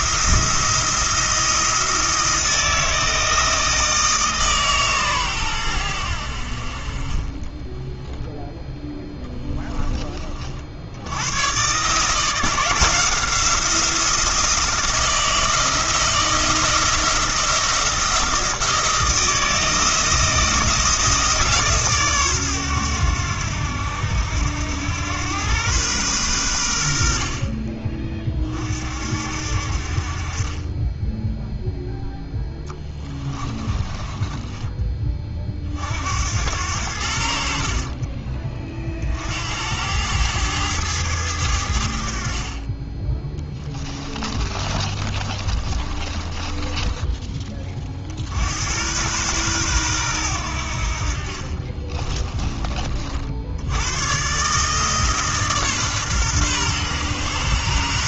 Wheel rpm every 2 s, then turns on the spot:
170, 160, 140, 50, 10, 60, 170, 170, 170, 160, 160, 110, 90, 90, 40, 20, 10, 20, 90, 40, 110, 30, 30, 20, 90, 70, 30, 150, 120.
8-10 32-34 44-48